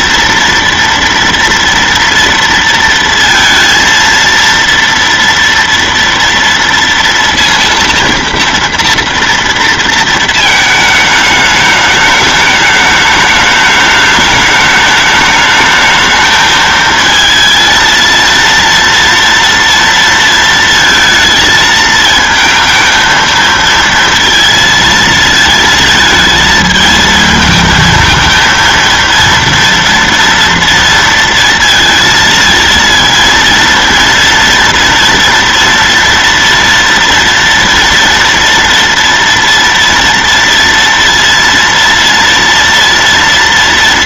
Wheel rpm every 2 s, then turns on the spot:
230, 230, 230, 230, 230, 220, 210, 210, 220, 230, 230, 230, 230, 220, 230, 230, 220, 230, 230, 230, 230, 230.
none